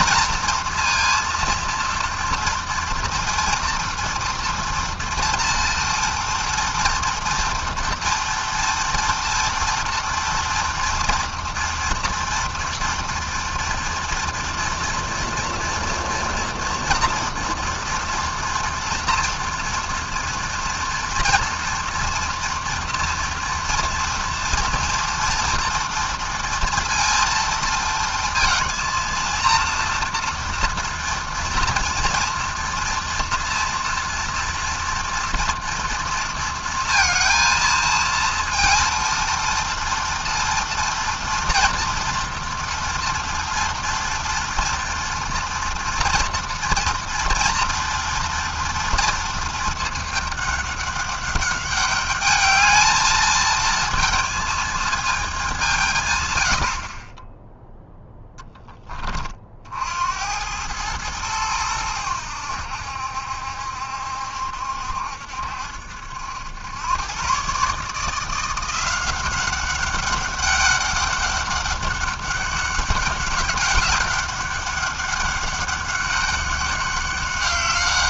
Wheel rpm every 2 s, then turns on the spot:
240, 230, 230, 230, 230, 240, 230, 230, 230, 230, 230, 230, 240, 230, 230, 230, 230, 230, 230, 230, 230, 230, 230, 230, 230, 200, 220, 210, 20, 30, 110, 70, 70, 120, 190, 200, 190, 200, 200.
none